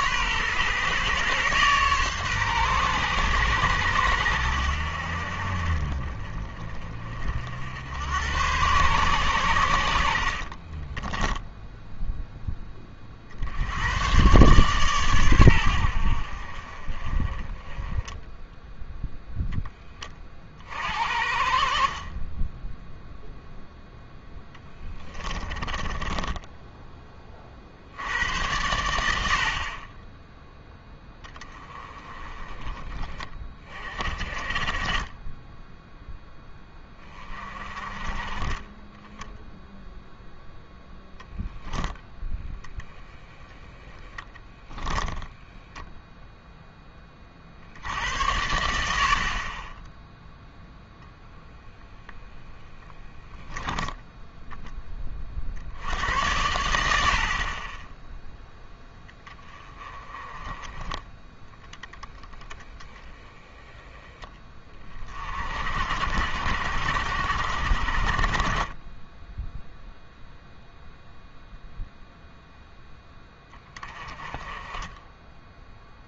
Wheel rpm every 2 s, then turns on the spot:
130, 130, 80, 30, 120, 40, 20, 130, 40, 0, 50, 10, 10, 10, 90, 10, 20, 30, 10, 20, 10, 10, 10, 10, 80, 0, 10, 10, 80, 10, 20, 20, 30, 70, 20, 0, 0, 20.
10-12 24-26 44-46